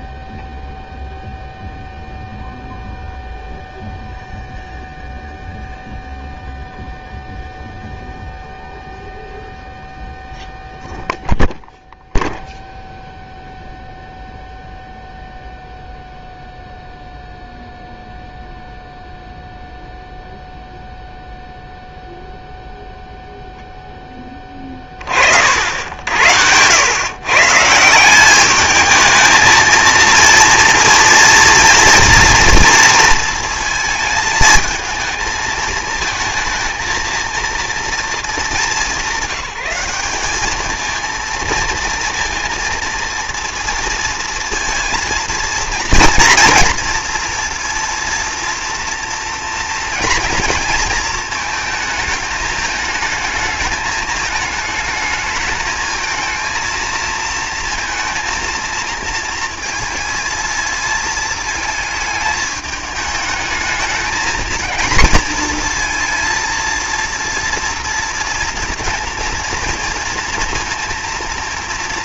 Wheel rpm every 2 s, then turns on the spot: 0, 0, 0, 0, 0, 0, 0, 0, 0, 0, 0, 10, 80, 190, 230, 230, 220, 220, 220, 200, 230, 230, 230, 230, 230, 220, 220, 220, 230, 220, 220, 220, 230, 230, 230, 230.
none